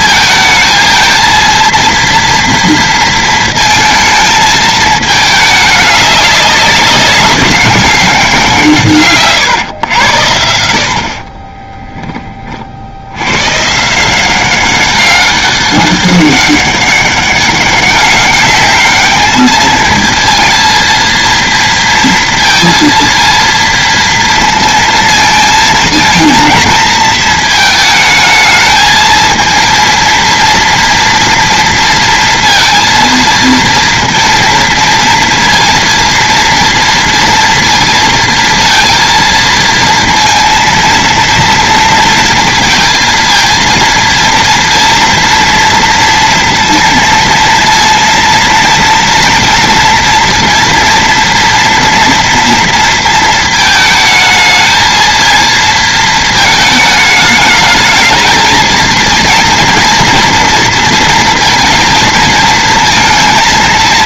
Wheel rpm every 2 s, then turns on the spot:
220, 230, 220, 200, 170, 80, 40, 190, 200, 200, 230, 230, 230, 230, 220, 230, 230, 230, 230, 230, 230, 230, 230, 230, 230, 230, 230, 220, 220, 220, 230, 220.
none